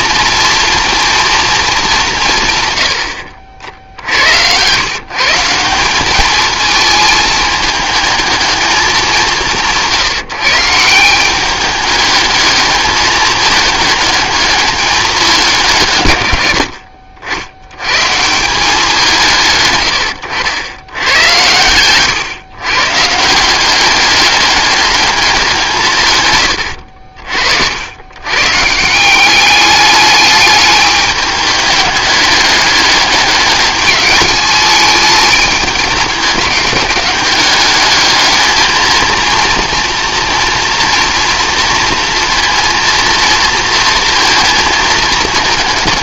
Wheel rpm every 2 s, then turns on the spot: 230, 140, 110, 220, 220, 170, 210, 210, 60, 170, 90, 130, 210, 100, 150, 210, 210, 210, 200, 220, 230, 230, 230.
26-28